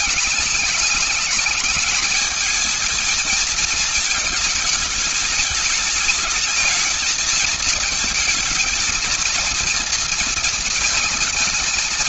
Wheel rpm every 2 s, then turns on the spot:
210, 220, 220, 220, 220, 230.
none